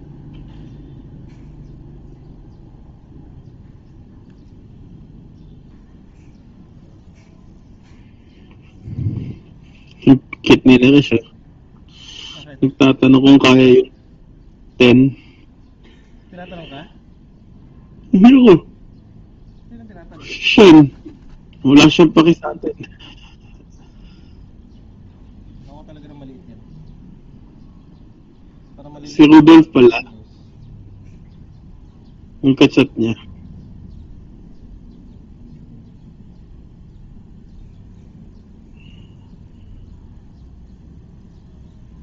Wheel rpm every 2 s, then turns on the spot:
0, 0, 0, 0, 0, 0, 0, 0, 0, 0, 0, 0, 0, 0, 0, 0, 0, 0, 0, 0, 0.
none